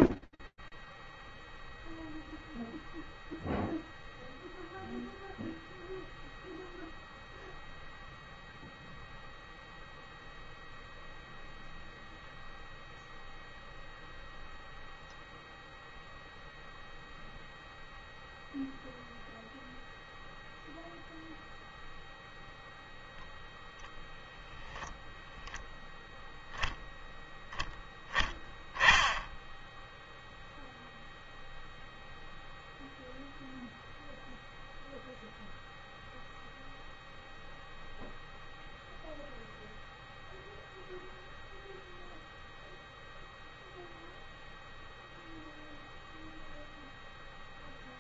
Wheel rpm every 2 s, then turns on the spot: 0, 0, 0, 0, 0, 0, 0, 0, 0, 0, 0, 0, 0, 10, 10, 0, 0, 0, 0, 0, 0, 0, 0, 0.
none